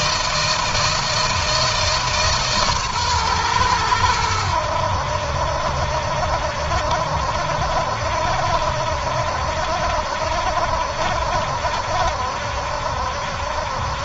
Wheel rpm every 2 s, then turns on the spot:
160, 130, 80, 60, 70, 70, 70.
none